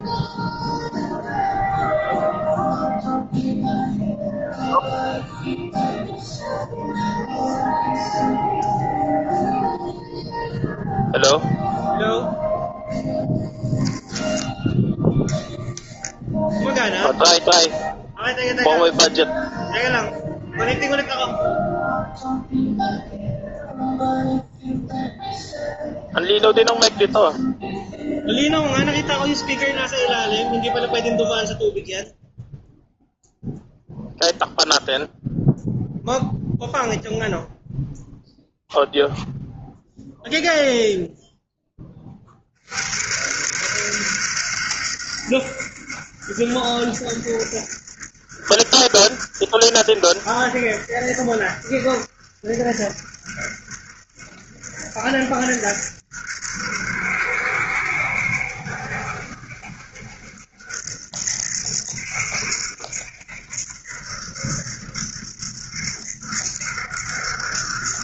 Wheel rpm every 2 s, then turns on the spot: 0, 0, 0, 0, 0, 0, 0, 0, 10, 0, 0, 0, 0, 0, 0, 0, 0, 0, 0, 0, 0, 10, 60, 70, 70, 70, 70, 70, 70, 70, 70, 70, 70, 70.
16-18